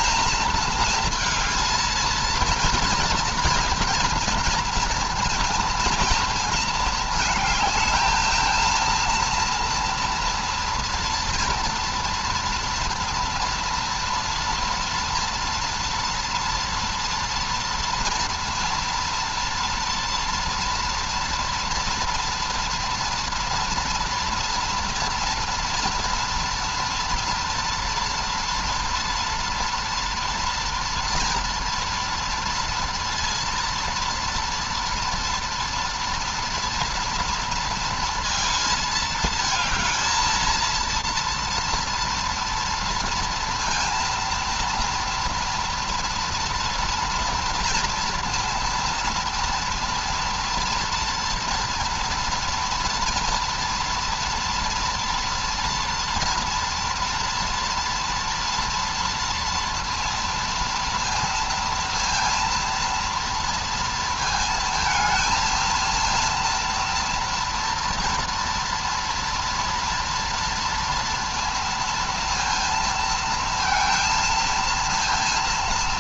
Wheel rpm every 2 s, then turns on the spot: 220, 230, 230, 220, 230, 230, 230, 230, 230, 230, 230, 230, 230, 240, 230, 240, 230, 230, 230, 220, 230, 230, 230, 230, 230, 230, 230, 230, 230, 230, 230, 240, 220, 230, 230, 230, 230, 230.
none